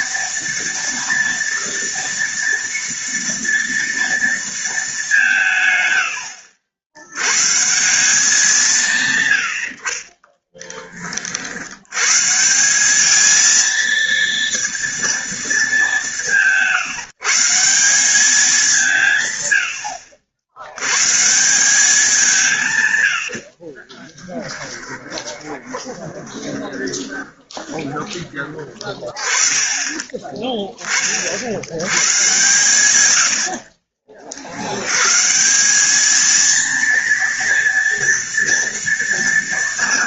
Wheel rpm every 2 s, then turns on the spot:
230, 230, 210, 90, 140, 30, 200, 230, 150, 170, 120, 110, 20, 20, 20, 30, 110, 110, 230, 230.
24-28